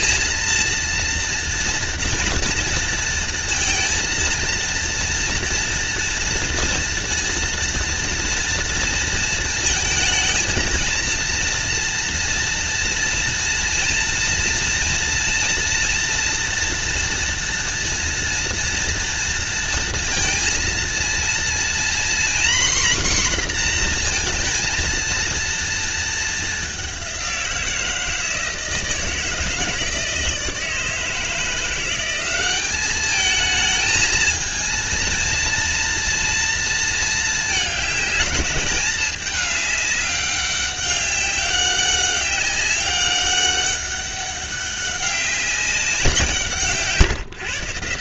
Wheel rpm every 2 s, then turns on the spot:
230, 230, 230, 230, 230, 230, 230, 230, 230, 230, 230, 250, 230, 190, 160, 160, 210, 230, 220, 200, 200, 200, 200, 140.
none